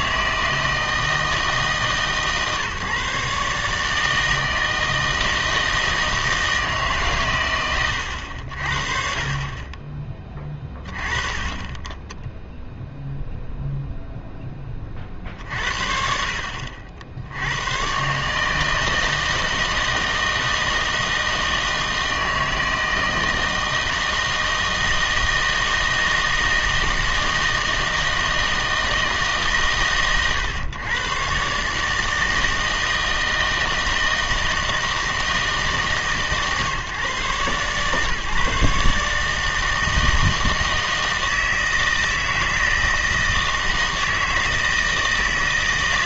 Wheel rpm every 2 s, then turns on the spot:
160, 140, 160, 150, 50, 20, 0, 30, 60, 160, 160, 160, 160, 160, 160, 120, 160, 160, 140, 150, 160, 160, 160.
none